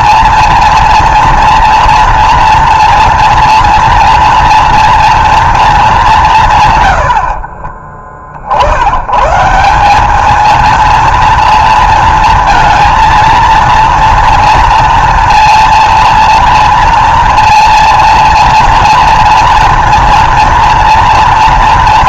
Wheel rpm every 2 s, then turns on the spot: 230, 230, 230, 80, 120, 230, 230, 230, 230, 230, 230.
6-8